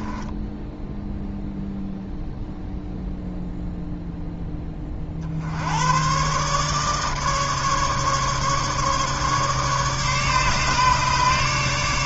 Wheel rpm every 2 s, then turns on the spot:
10, 0, 20, 140, 150, 150.
0-2